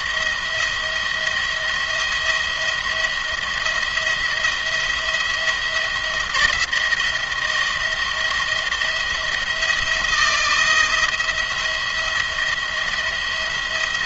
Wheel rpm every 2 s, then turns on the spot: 170, 170, 170, 170, 170, 170, 170.
none